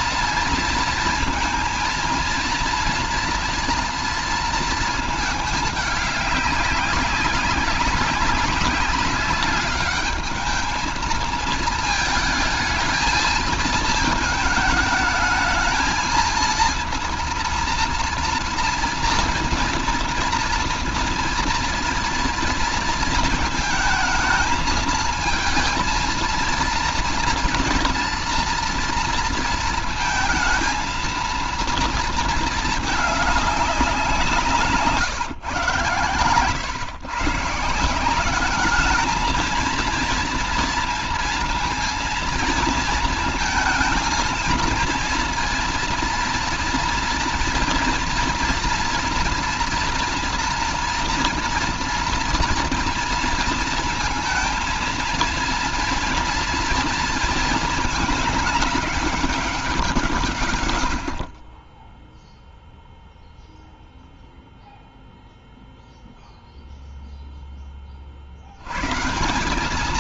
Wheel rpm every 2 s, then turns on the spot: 230, 230, 230, 200, 200, 220, 220, 220, 230, 230, 230, 230, 220, 230, 230, 230, 220, 160, 120, 210, 230, 230, 230, 230, 230, 230, 230, 230, 230, 210, 110, 0, 0, 0, 120.
none